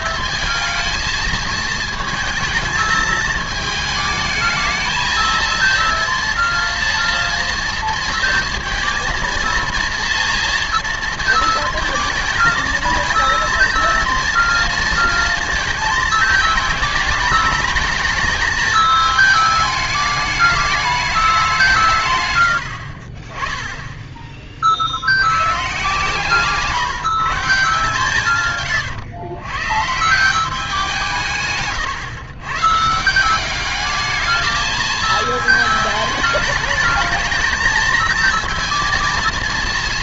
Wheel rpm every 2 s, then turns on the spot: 230, 220, 220, 230, 230, 230, 220, 230, 210, 210, 210, 90, 40, 140, 130, 180, 130, 220, 210, 230.
22-24 28-30